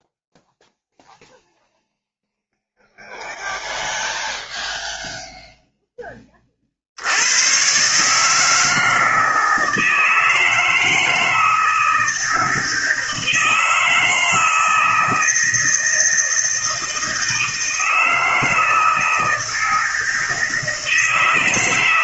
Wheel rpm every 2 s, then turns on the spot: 0, 0, 0, 30, 150, 160, 160, 160, 160, 160, 160.
none